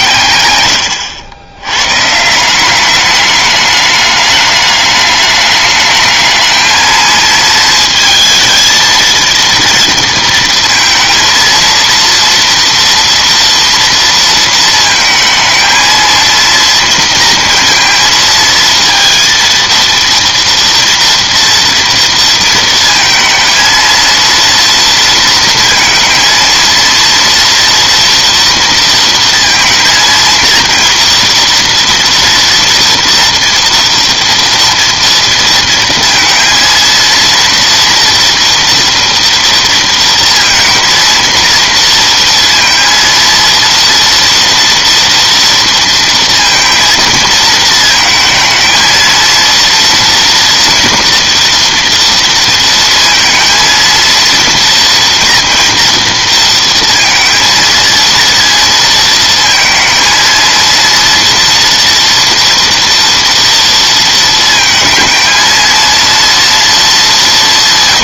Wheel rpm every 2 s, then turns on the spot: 110, 190, 210, 220, 220, 230, 230, 230, 230, 230, 230, 230, 230, 230, 230, 230, 240, 230, 230, 240, 230, 230, 230, 230, 220, 230, 230, 230, 230, 230, 230, 230, 220, 220.
none